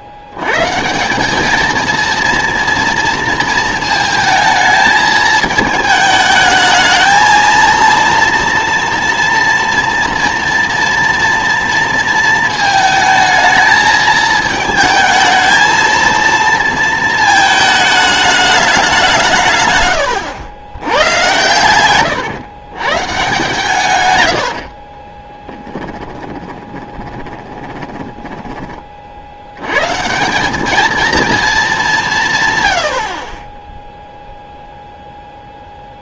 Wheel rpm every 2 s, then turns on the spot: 140, 230, 220, 220, 230, 230, 220, 220, 230, 200, 100, 140, 50, 20, 30, 210, 80, 0.
24-28